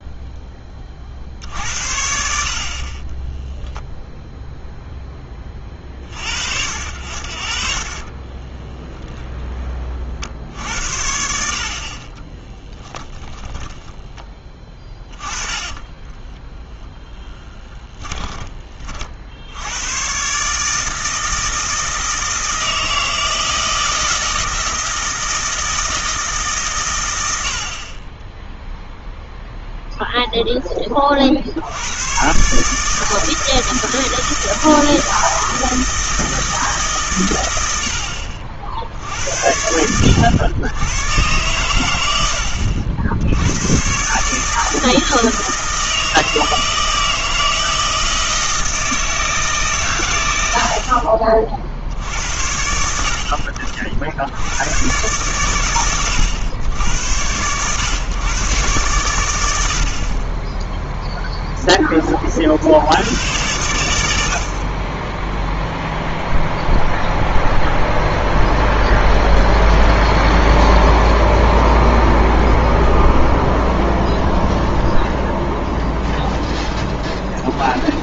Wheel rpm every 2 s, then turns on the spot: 10, 50, 0, 60, 10, 60, 10, 20, 10, 30, 140, 160, 160, 140, 10, 10, 140, 160, 160, 70, 100, 70, 150, 160, 160, 90, 70, 100, 110, 120, 10, 50, 60, 0, 0, 0, 0, 0, 0.
8-10 12-18